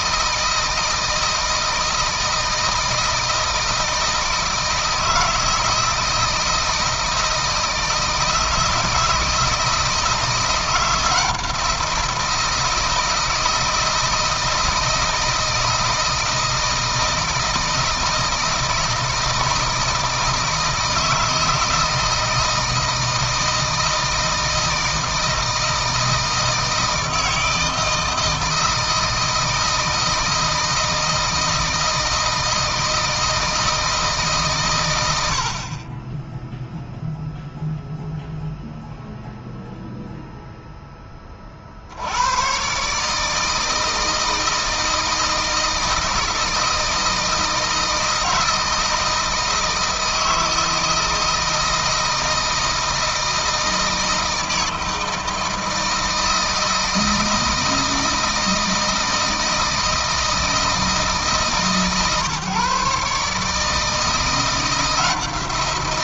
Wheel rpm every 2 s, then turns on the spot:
160, 160, 160, 160, 160, 170, 160, 160, 160, 160, 160, 160, 160, 160, 160, 160, 160, 120, 0, 0, 10, 140, 160, 160, 160, 160, 160, 160, 160, 160, 160, 140, 170.
none